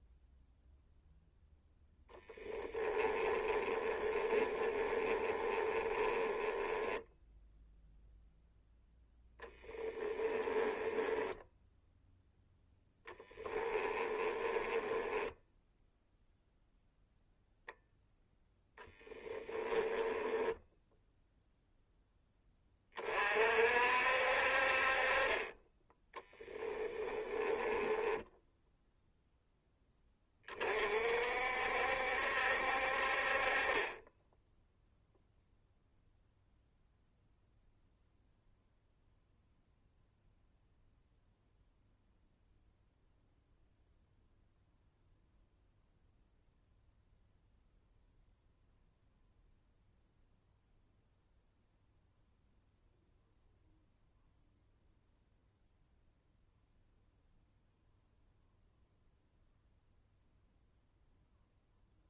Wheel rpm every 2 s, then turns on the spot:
0, 20, 20, 10, 0, 10, 10, 10, 0, 10, 0, 30, 40, 20, 0, 40, 60, 0, 0, 0, 0, 0, 0, 0, 0, 0, 0, 0, 0, 0, 0.
2-8 10-16 18-20 26-28